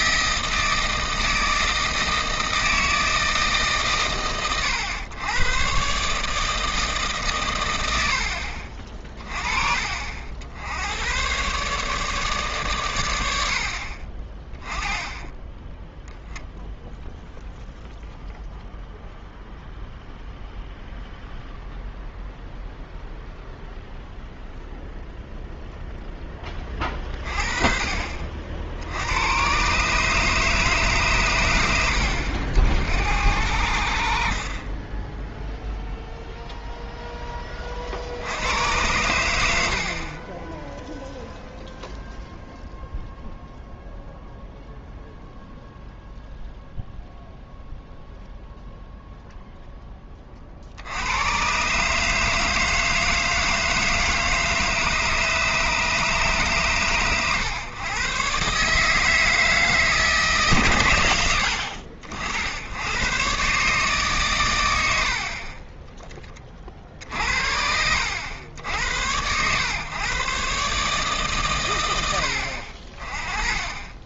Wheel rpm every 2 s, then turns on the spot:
160, 160, 110, 160, 40, 80, 130, 20, 0, 0, 0, 0, 0, 20, 60, 150, 70, 40, 0, 80, 10, 0, 0, 0, 0, 60, 160, 150, 130, 150, 130, 80, 90, 30, 80, 140, 60.
none